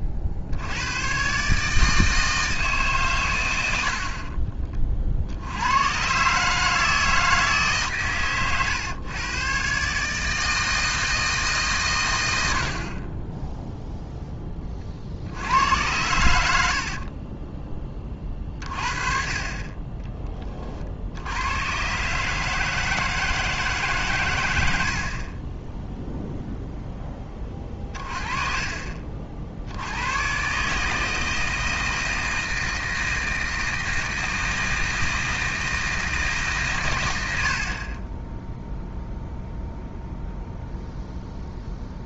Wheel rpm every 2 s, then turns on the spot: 100, 150, 40, 150, 120, 160, 70, 20, 60, 40, 40, 160, 80, 0, 40, 150, 160, 160, 130, 0, 0.
28-30